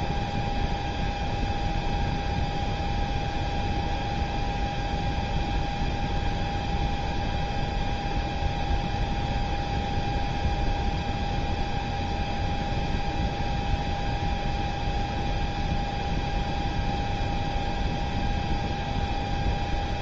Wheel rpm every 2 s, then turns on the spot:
0, 0, 0, 0, 0, 0, 0, 0, 0, 0.
none